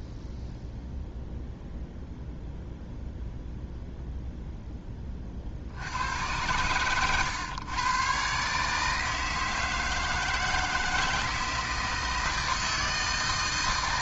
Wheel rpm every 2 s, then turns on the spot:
0, 0, 10, 110, 140, 160, 160.
none